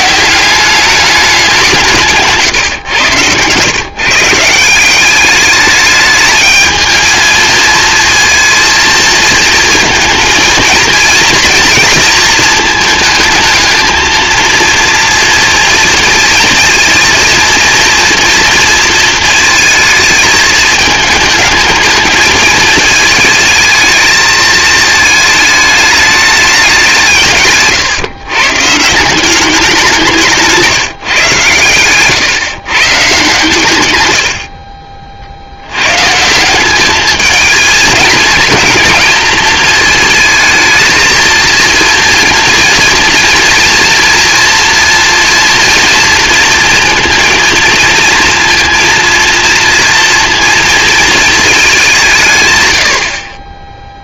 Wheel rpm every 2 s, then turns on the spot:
210, 120, 190, 220, 230, 230, 220, 230, 230, 220, 220, 220, 220, 160, 170, 150, 140, 50, 220, 230, 220, 230, 230, 230, 230, 220, 40.
none